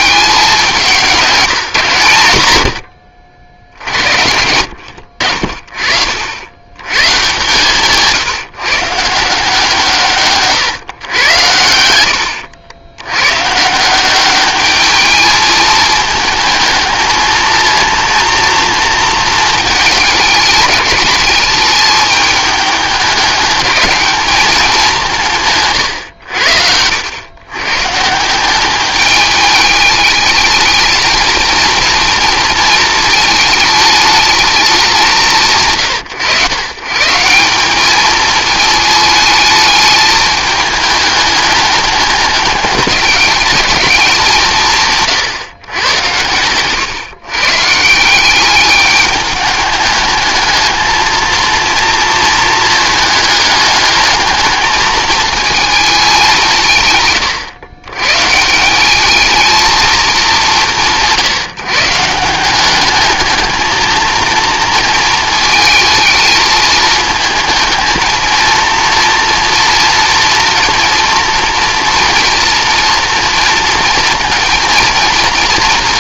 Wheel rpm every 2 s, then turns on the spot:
190, 70, 80, 110, 150, 130, 90, 210, 220, 230, 200, 210, 190, 90, 200, 220, 230, 200, 130, 220, 210, 200, 150, 130, 200, 220, 220, 210, 140, 190, 180, 200, 230, 220, 230, 230, 230, 230.
none